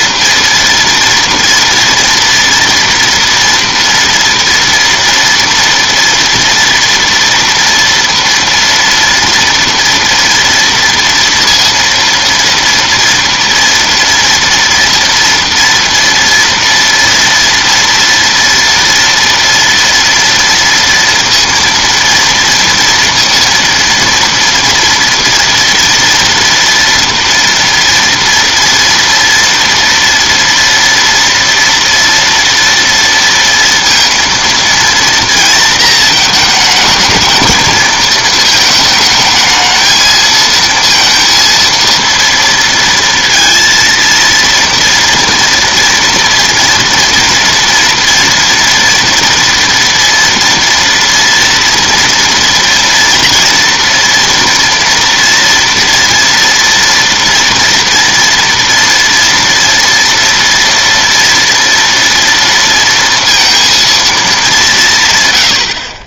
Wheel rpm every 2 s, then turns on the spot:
230, 230, 230, 230, 230, 230, 230, 230, 230, 240, 230, 230, 230, 230, 230, 240, 230, 230, 220, 220, 220, 230, 230, 230, 230, 230, 230, 230, 230, 230, 230, 230, 220.
none